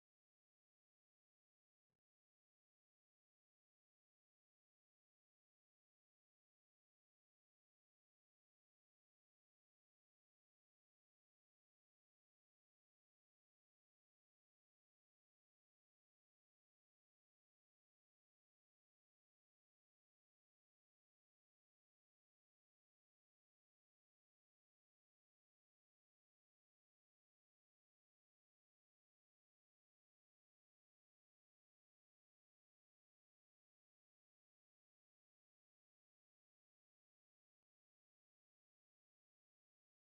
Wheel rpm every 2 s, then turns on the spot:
0, 0, 0, 0, 0, 0, 0, 0, 0, 0, 0, 0, 0, 0, 0, 0, 0, 0, 0, 0.
none